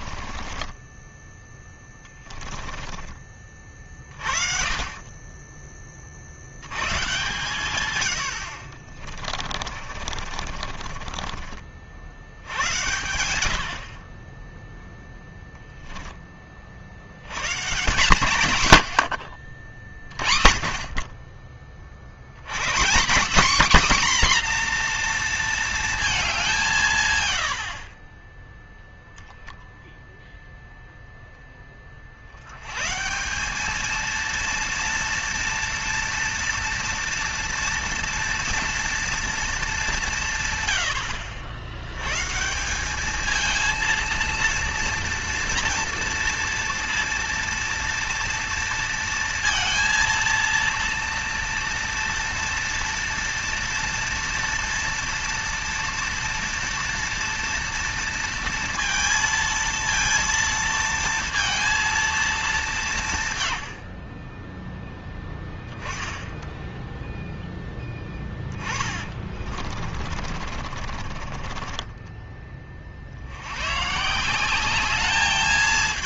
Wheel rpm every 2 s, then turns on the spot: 20, 20, 30, 100, 60, 40, 100, 10, 50, 110, 30, 170, 260, 170, 0, 0, 120, 230, 230, 230, 100, 180, 230, 230, 230, 230, 230, 230, 230, 230, 230, 190, 10, 10, 20, 40, 40, 190.
0-4 8-12 68-72